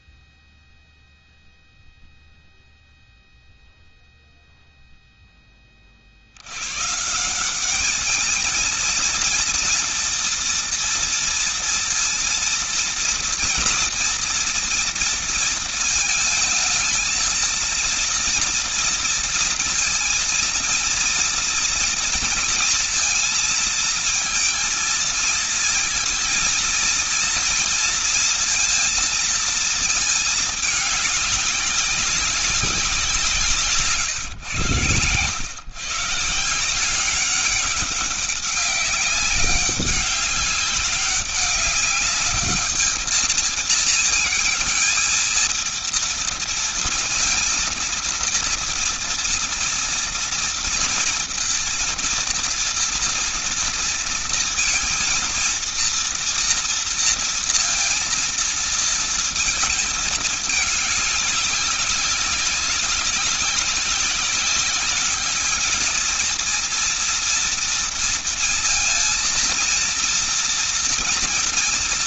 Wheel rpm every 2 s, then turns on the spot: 0, 0, 0, 100, 220, 240, 230, 230, 220, 230, 230, 230, 230, 230, 230, 210, 190, 120, 160, 190, 200, 210, 220, 230, 230, 230, 230, 230, 230, 230, 220, 200, 200, 230, 230, 230.
none